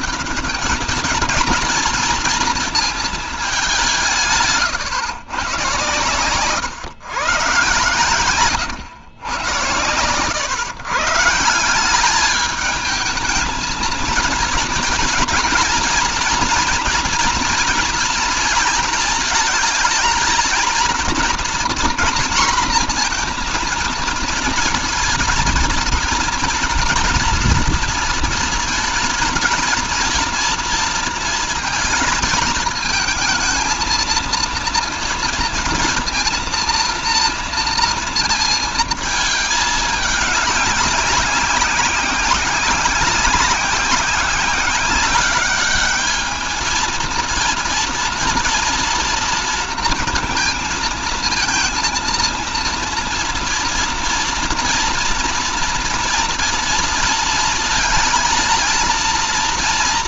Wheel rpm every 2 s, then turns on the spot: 210, 220, 150, 120, 120, 120, 210, 230, 230, 220, 230, 240, 230, 230, 230, 230, 220, 230, 230, 220, 190, 190, 190, 220, 230, 230, 230, 230, 230, 230.
none